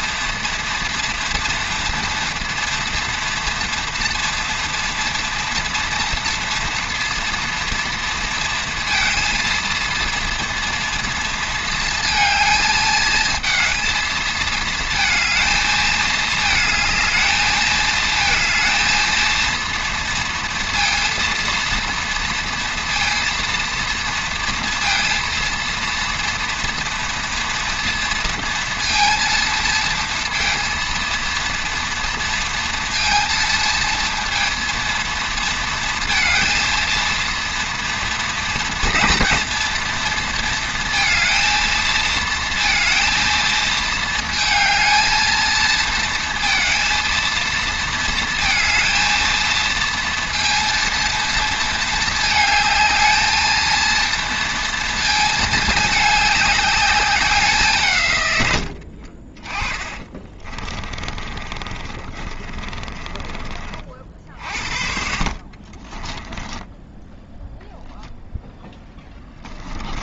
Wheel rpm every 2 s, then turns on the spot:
230, 230, 230, 230, 230, 230, 220, 220, 220, 220, 230, 230, 230, 230, 230, 230, 230, 230, 230, 230, 230, 230, 220, 230, 220, 230, 220, 230, 200, 80, 30, 30, 50, 10, 0.
58-64 66-68